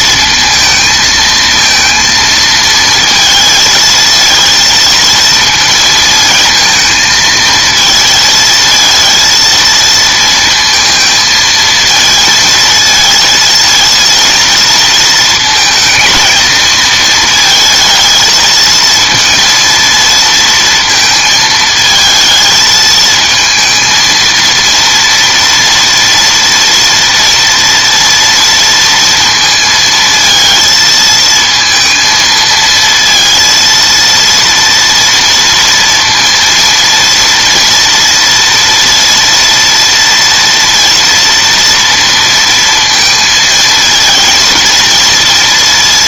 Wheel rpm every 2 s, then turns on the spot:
220, 230, 230, 220, 220, 230, 230, 230, 220, 220, 230, 220, 230, 230, 230, 230, 230, 230, 230, 230, 230, 230, 230.
none